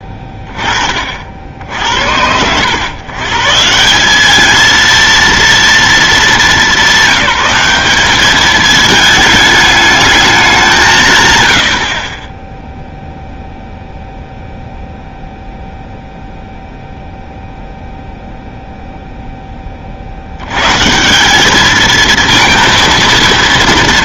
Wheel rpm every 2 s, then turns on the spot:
30, 110, 230, 190, 220, 190, 0, 0, 0, 0, 110, 230.
none